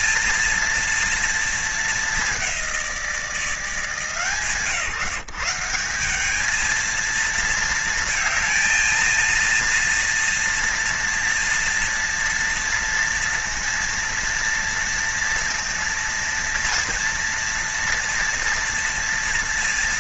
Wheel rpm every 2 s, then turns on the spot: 230, 180, 140, 220, 230, 230, 230, 230, 230, 230.
none